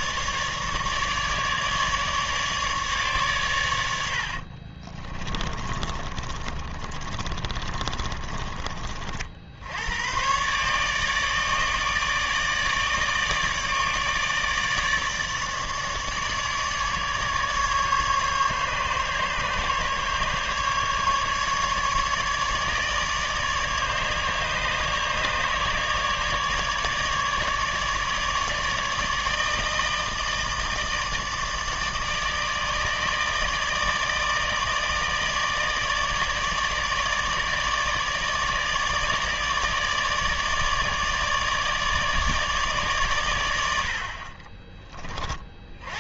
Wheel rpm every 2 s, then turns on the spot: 150, 150, 40, 30, 30, 140, 150, 150, 150, 140, 140, 150, 150, 150, 150, 160, 150, 160, 150, 150, 150, 140, 20.
4-8 44-46